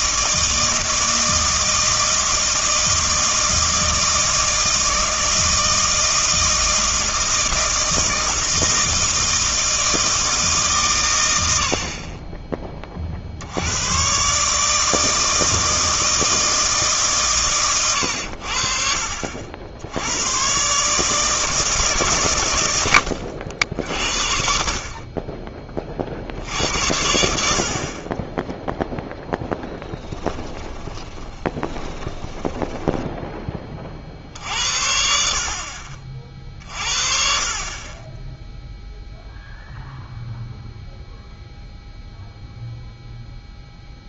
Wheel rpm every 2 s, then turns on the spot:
160, 160, 160, 160, 160, 150, 20, 150, 160, 60, 120, 110, 50, 70, 0, 20, 20, 70, 50, 0, 0, 0.
30-34